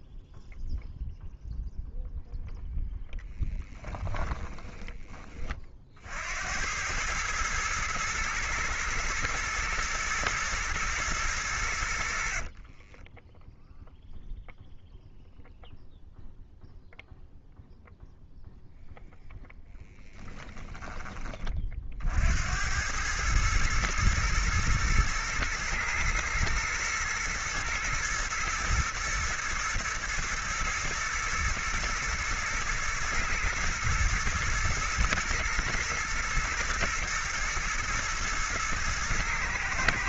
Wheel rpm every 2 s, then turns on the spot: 0, 0, 20, 90, 110, 120, 30, 0, 0, 0, 20, 90, 110, 110, 110, 110, 120, 110, 120, 110.
12-14